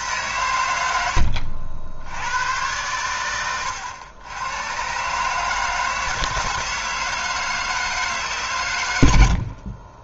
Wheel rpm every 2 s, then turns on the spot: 90, 110, 120, 160, 120.
none